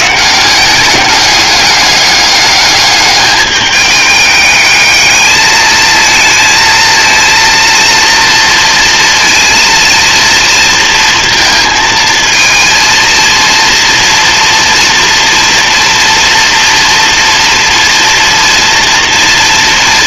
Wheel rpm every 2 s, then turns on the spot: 200, 200, 220, 230, 230, 230, 230, 230, 230, 230.
none